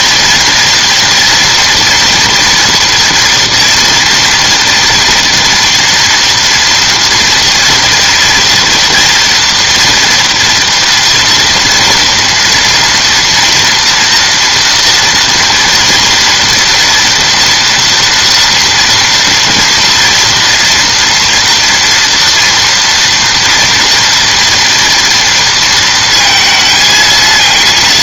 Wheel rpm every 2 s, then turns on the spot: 240, 230, 230, 230, 230, 230, 230, 230, 230, 240, 230, 230, 230, 220.
none